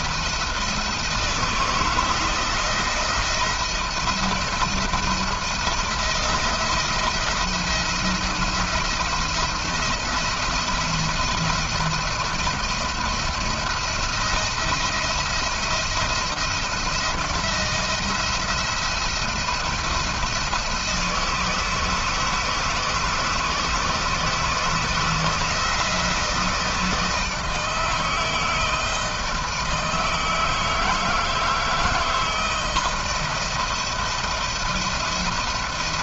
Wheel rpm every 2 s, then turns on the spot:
160, 160, 170, 170, 170, 170, 170, 170, 170, 170, 160, 160, 160, 160, 160, 160, 170, 170.
none